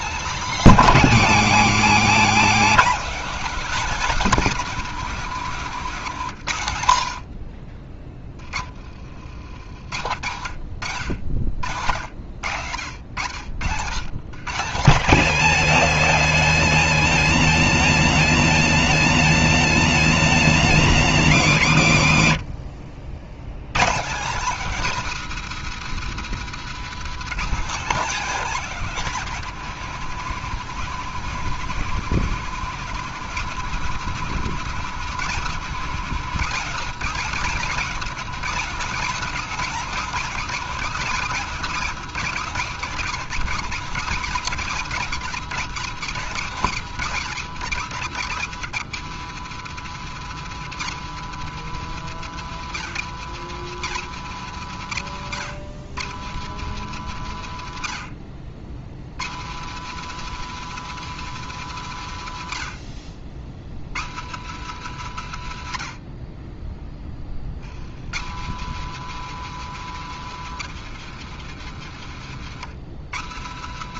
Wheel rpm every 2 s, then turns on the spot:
270, 270, 240, 80, 50, 80, 70, 190, 200, 200, 190, 90, 220, 190, 210, 200, 220, 230, 210, 230, 210, 170, 140, 160, 160, 180, 150, 120, 140, 90, 180, 50, 130, 30, 170, 150, 130.
none